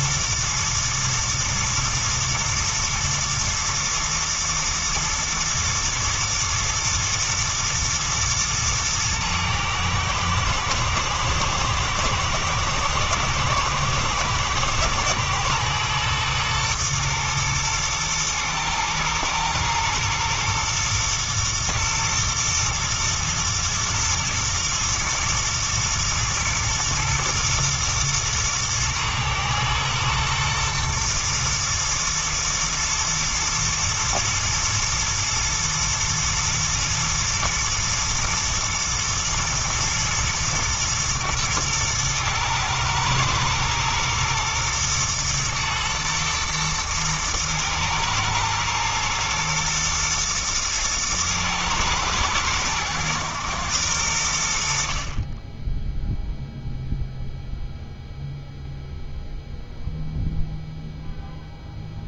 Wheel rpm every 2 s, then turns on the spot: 110, 110, 110, 120, 110, 110, 120, 120, 110, 110, 120, 120, 110, 110, 110, 120, 120, 110, 120, 110, 120, 110, 120, 110, 110, 110, 110, 50, 0, 0, 0.
none